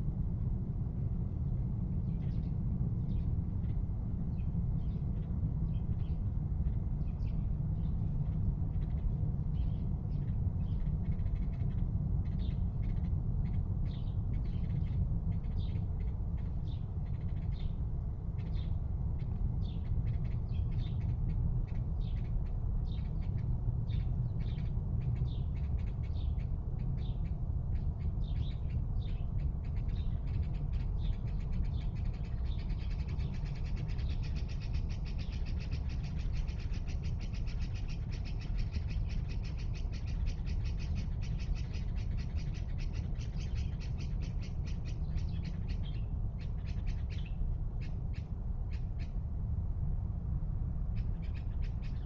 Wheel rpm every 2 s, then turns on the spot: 0, 0, 0, 0, 0, 0, 0, 0, 0, 0, 0, 0, 0, 0, 0, 0, 0, 0, 0, 0, 0, 0, 0, 0, 0, 0.
none